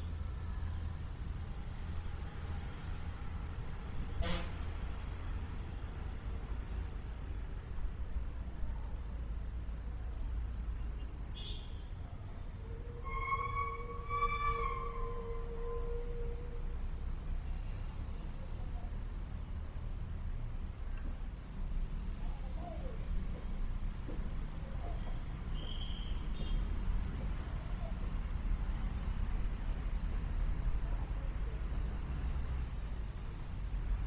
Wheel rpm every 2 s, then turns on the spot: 0, 0, 0, 0, 0, 0, 0, 0, 0, 0, 0, 0, 0, 0, 0, 0, 0.
none